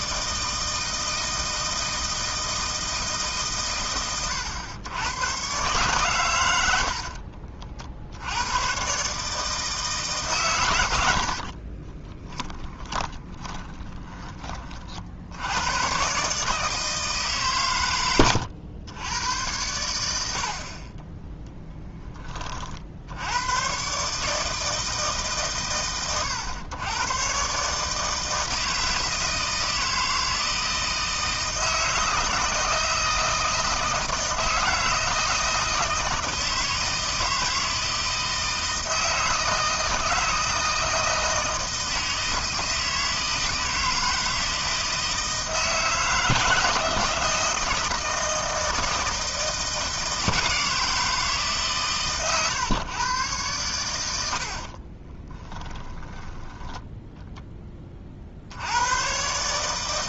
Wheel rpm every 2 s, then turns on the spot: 160, 160, 100, 70, 120, 70, 20, 50, 150, 90, 0, 60, 160, 100, 160, 160, 160, 160, 160, 160, 160, 160, 160, 160, 160, 160, 130, 50, 0, 90.
6-8 10-14 54-56